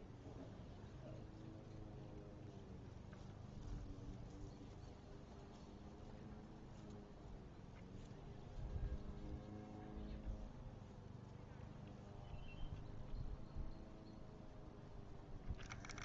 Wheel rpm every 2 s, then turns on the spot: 0, 0, 0, 0, 0, 0, 0, 0.
none